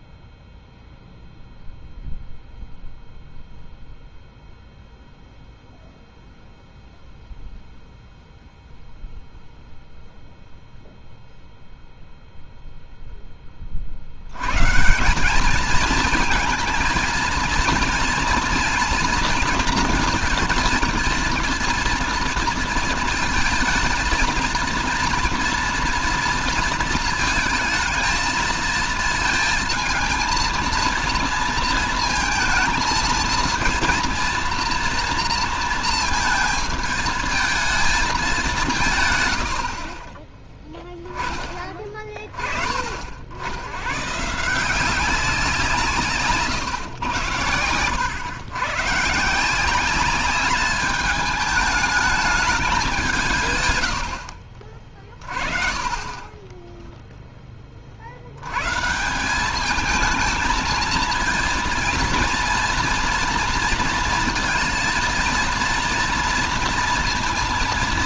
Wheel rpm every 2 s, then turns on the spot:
0, 0, 0, 0, 0, 0, 0, 140, 230, 230, 230, 230, 230, 230, 220, 230, 230, 230, 220, 180, 0, 40, 170, 120, 120, 210, 190, 40, 10, 140, 230, 230, 230, 230.
56-58